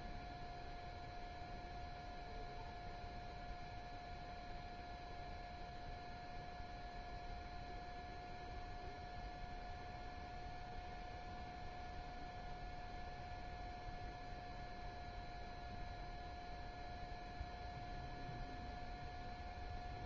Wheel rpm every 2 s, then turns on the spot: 0, 0, 0, 0, 0, 0, 0, 0, 0, 0.
none